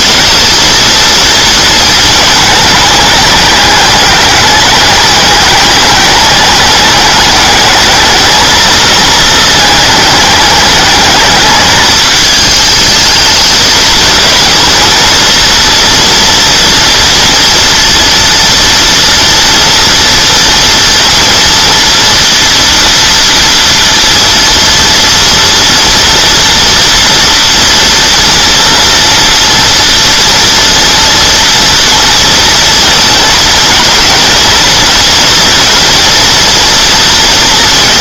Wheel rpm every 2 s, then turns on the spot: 230, 210, 210, 210, 220, 210, 220, 230, 230, 230, 230, 230, 230, 230, 230, 230, 230, 230, 230.
none